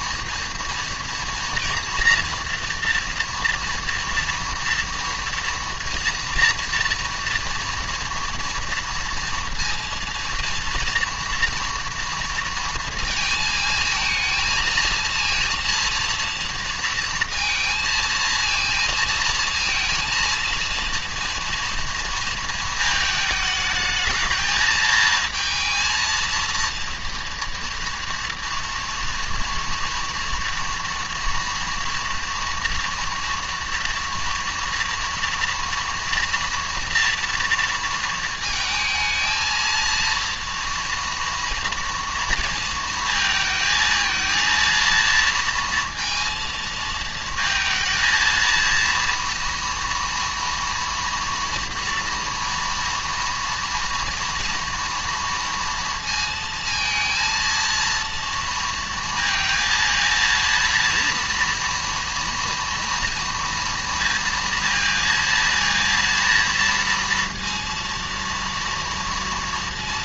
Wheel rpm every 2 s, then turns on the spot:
230, 230, 230, 230, 230, 230, 230, 220, 230, 230, 230, 220, 220, 230, 230, 230, 230, 230, 230, 220, 230, 230, 230, 230, 230, 230, 230, 240, 230, 230, 230, 230, 230, 230, 230.
none